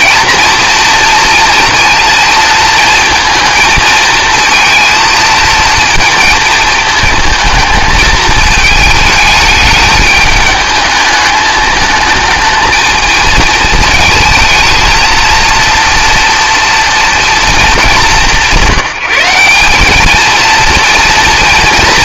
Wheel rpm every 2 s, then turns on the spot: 230, 230, 230, 220, 220, 210, 220, 220, 230, 190, 230.
none